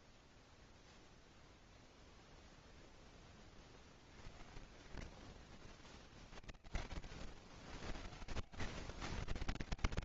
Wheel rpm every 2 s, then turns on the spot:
0, 20, 70, 90, 150.
4-6